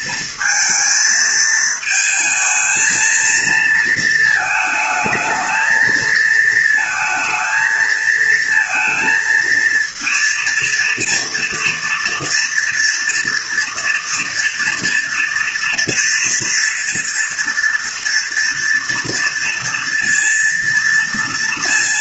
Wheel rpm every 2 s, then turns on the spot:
220, 230, 220, 230, 230, 230, 240, 230, 230, 230, 230.
none